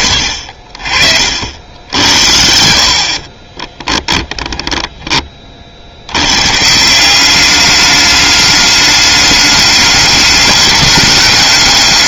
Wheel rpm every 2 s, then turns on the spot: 60, 70, 10, 140, 210, 210.
4-6